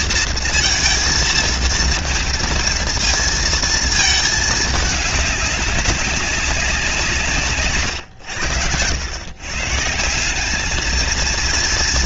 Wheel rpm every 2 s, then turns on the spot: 230, 220, 220, 190, 110, 200.
none